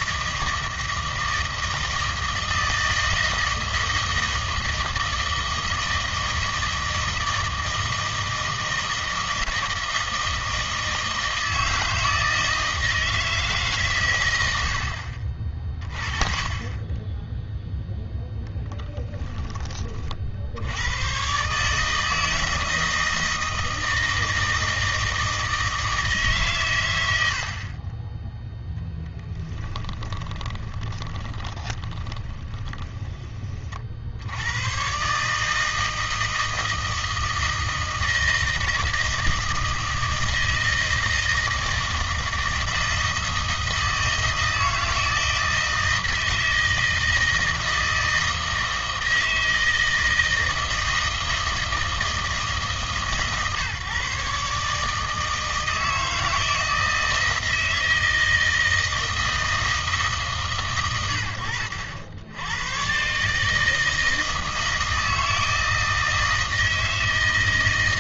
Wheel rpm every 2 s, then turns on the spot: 160, 160, 160, 160, 160, 160, 160, 80, 20, 10, 80, 160, 160, 130, 0, 20, 20, 110, 160, 160, 160, 160, 160, 160, 160, 160, 160, 140, 160, 160, 120, 110, 160, 160.
18-20 30-34